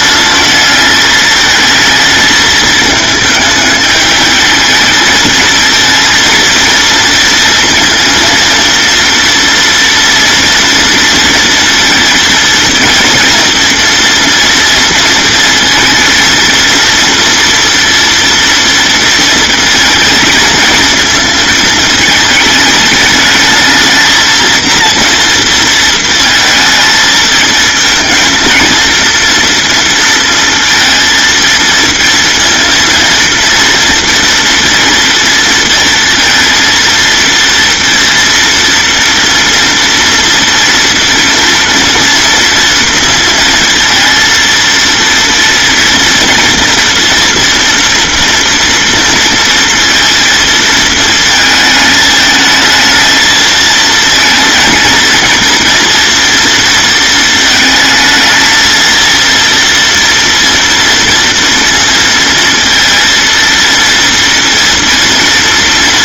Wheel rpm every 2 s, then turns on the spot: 220, 220, 220, 230, 230, 230, 230, 230, 230, 230, 220, 210, 230, 220, 230, 230, 230, 230, 230, 240, 230, 230, 230, 230, 230, 230, 220, 230, 230, 230, 230, 230, 230.
none